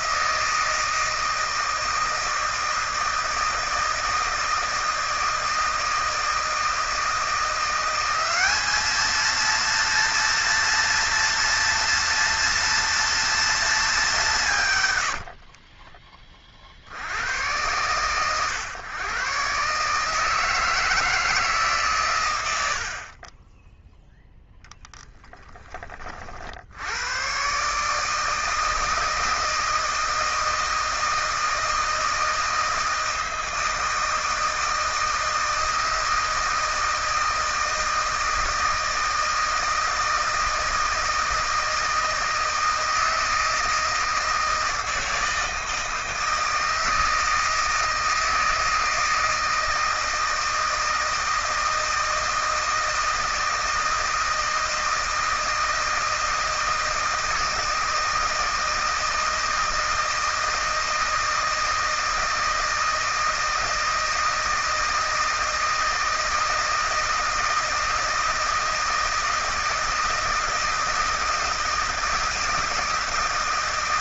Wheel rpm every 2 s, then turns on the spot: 160, 160, 160, 160, 200, 230, 230, 180, 30, 120, 150, 100, 0, 50, 160, 160, 160, 160, 160, 160, 160, 160, 160, 160, 160, 160, 160, 160, 160, 160, 160, 160, 160, 160, 160, 170, 160.
none